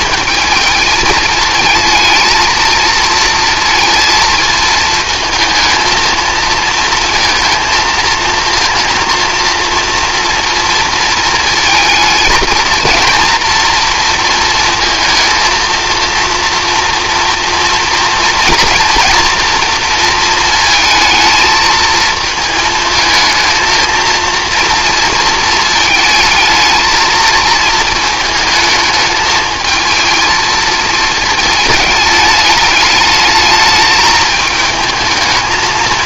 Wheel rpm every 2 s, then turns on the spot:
220, 230, 220, 230, 230, 230, 230, 230, 230, 230, 230, 220, 230, 230, 220, 220, 210, 220.
none